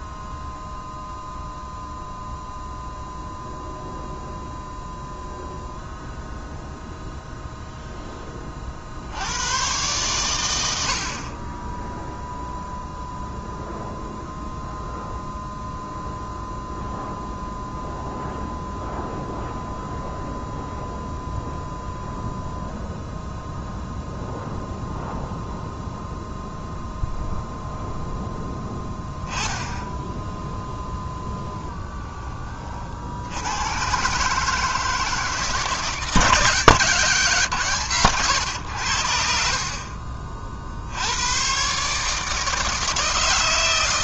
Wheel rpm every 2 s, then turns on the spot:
0, 0, 0, 0, 50, 70, 0, 0, 0, 0, 0, 0, 0, 0, 10, 0, 40, 150, 150, 80, 60, 160.
none